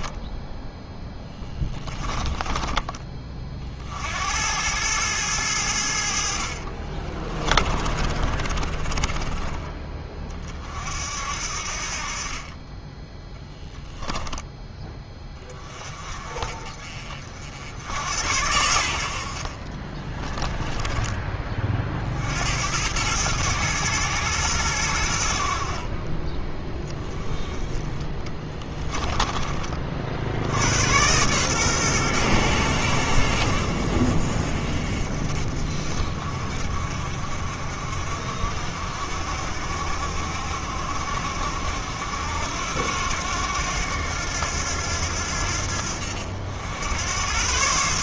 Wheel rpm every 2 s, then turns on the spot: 10, 20, 100, 40, 30, 50, 20, 20, 40, 80, 10, 90, 90, 10, 10, 100, 100, 50, 50, 60, 60, 90, 80, 90.
6-10 28-30